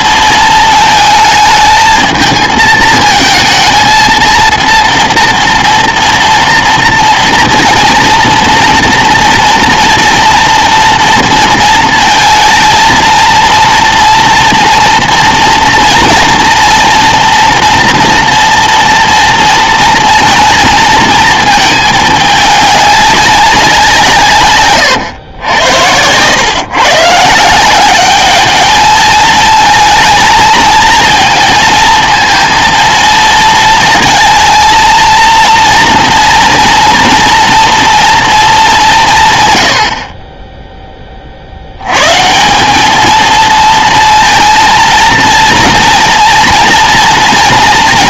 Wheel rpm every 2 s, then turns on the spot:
220, 220, 230, 230, 230, 230, 230, 230, 230, 230, 230, 210, 120, 130, 220, 230, 230, 230, 230, 190, 10, 210, 230, 230.
none